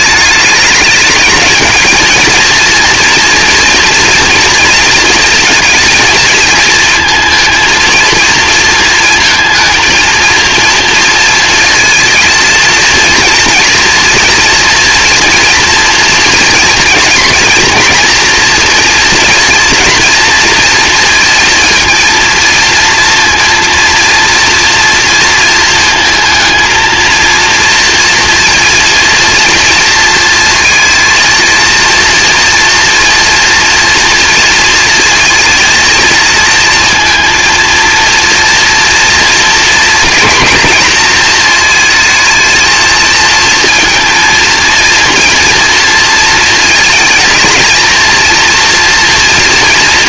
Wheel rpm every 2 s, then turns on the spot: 210, 230, 230, 220, 230, 230, 230, 230, 230, 230, 230, 230, 230, 220, 230, 230, 230, 230, 230, 230, 240, 220, 230, 230, 230.
none